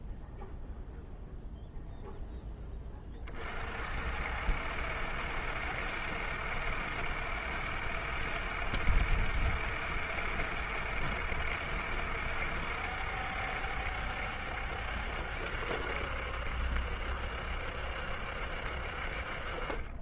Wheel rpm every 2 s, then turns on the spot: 0, 10, 60, 60, 70, 70, 70, 70, 70, 70.
none